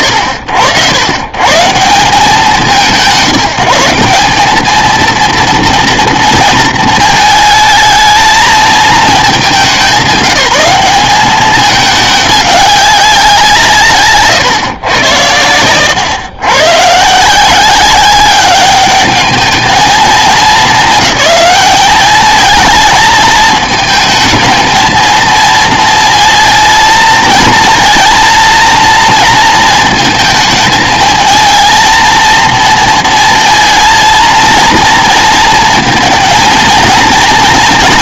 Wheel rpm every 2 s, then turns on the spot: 130, 170, 210, 230, 220, 190, 200, 120, 110, 200, 190, 220, 220, 230, 230, 220, 230, 230, 230.
none